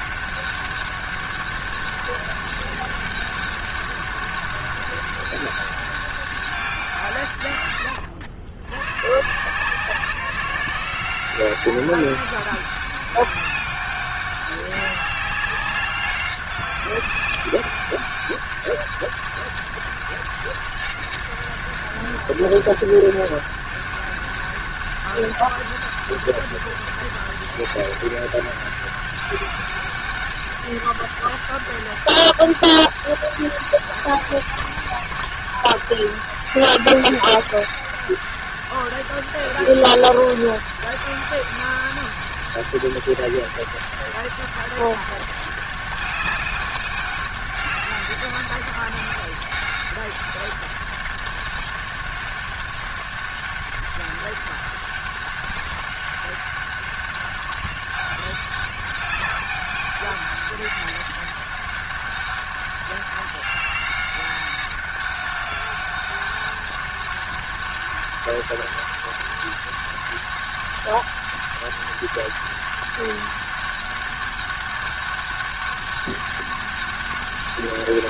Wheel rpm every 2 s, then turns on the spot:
200, 200, 200, 180, 100, 180, 200, 200, 190, 200, 200, 200, 200, 200, 200, 200, 200, 200, 200, 200, 200, 190, 190, 200, 200, 200, 190, 200, 200, 200, 200, 200, 200, 200, 200, 200, 200, 200, 200.
none